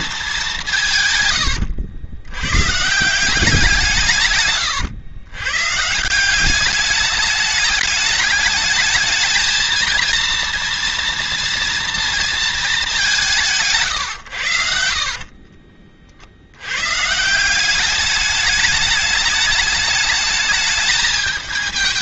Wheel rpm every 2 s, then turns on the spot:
200, 120, 130, 180, 210, 230, 220, 110, 80, 210, 220.
none